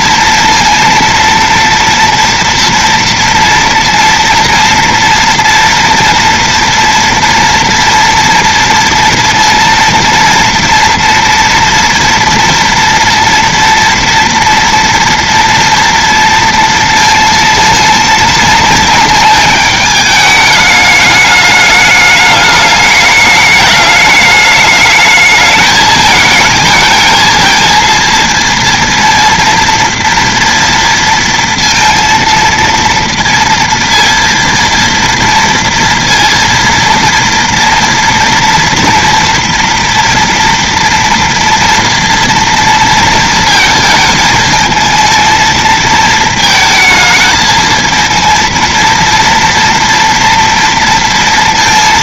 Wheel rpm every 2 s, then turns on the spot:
230, 230, 230, 230, 230, 240, 230, 230, 230, 230, 210, 210, 210, 220, 230, 230, 230, 230, 230, 230, 230, 230, 220, 220, 230, 230.
none